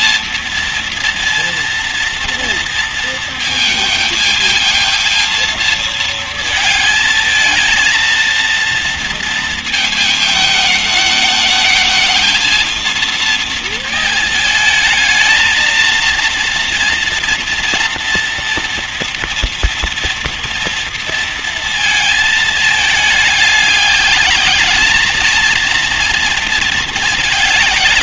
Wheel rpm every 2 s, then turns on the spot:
230, 230, 220, 220, 230, 220, 230, 220, 230, 230, 230, 210, 210, 220.
none